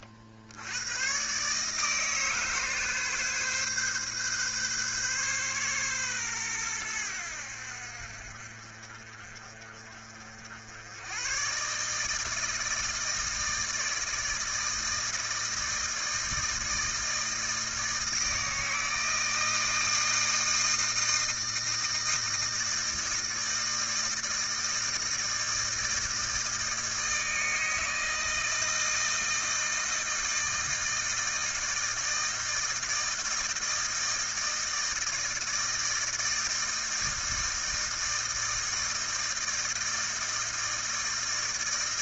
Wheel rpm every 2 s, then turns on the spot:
50, 150, 140, 130, 60, 60, 160, 160, 160, 160, 160, 160, 160, 160, 160, 160, 160, 160, 160, 160, 160.
none